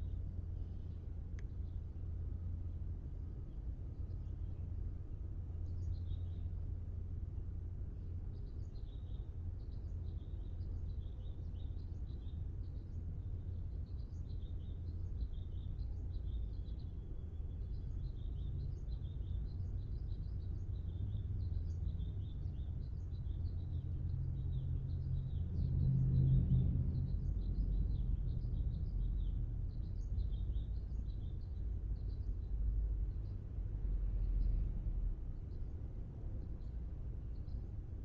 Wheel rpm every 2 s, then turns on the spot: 0, 0, 0, 0, 0, 0, 0, 0, 0, 0, 0, 0, 0, 0, 0, 0, 0, 0, 0.
none